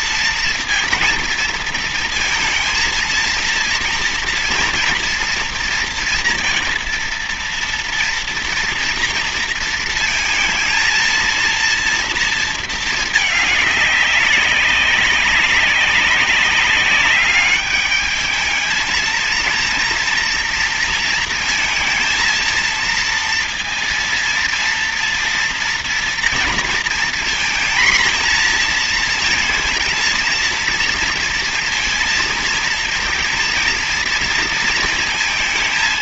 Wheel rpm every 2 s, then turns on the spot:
230, 230, 230, 230, 230, 230, 220, 200, 200, 220, 230, 230, 230, 230, 230, 230, 230, 230.
none